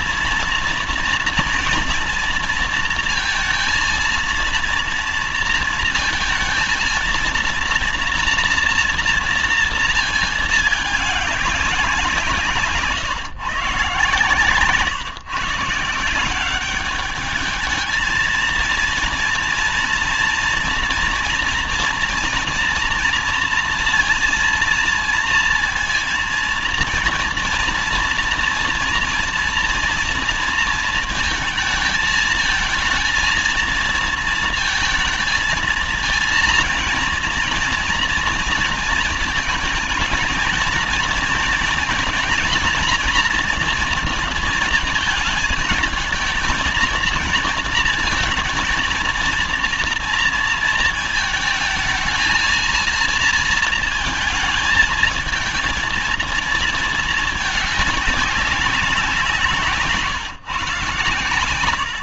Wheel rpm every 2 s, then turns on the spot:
230, 230, 230, 230, 230, 210, 150, 150, 200, 230, 230, 230, 230, 230, 230, 230, 220, 220, 230, 230, 230, 240, 230, 230, 230, 230, 230, 220, 220, 180, 130.
none